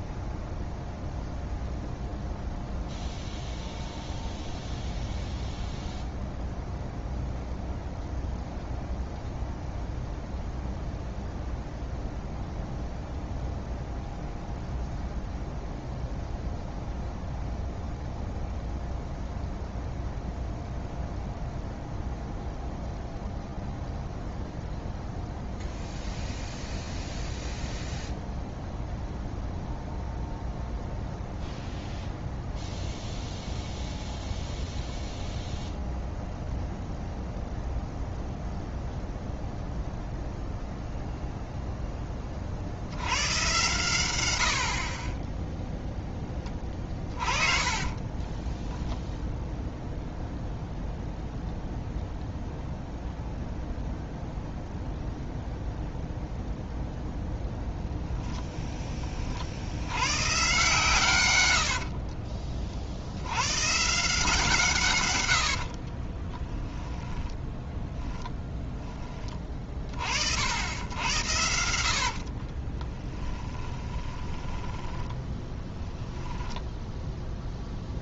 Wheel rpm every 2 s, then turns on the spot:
0, 0, 0, 0, 0, 0, 0, 0, 0, 0, 0, 0, 0, 0, 0, 0, 0, 0, 0, 0, 0, 70, 40, 30, 10, 0, 0, 0, 0, 10, 130, 50, 150, 10, 10, 80, 20, 10, 0.
46-50 66-68 72-76